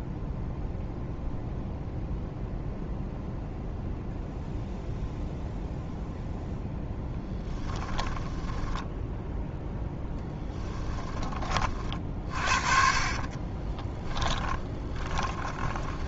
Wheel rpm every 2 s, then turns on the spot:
0, 0, 0, 0, 10, 10, 40, 20.
8-10 12-16